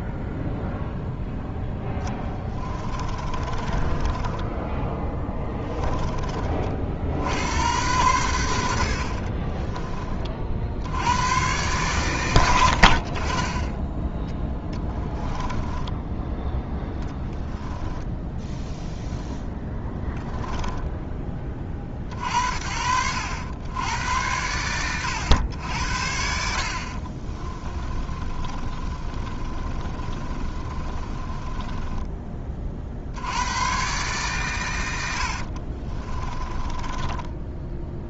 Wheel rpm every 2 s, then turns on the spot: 0, 20, 10, 50, 80, 90, 60, 10, 10, 0, 10, 60, 90, 60, 30, 30, 50, 90, 20.
2-6 12-16 26-32 36-38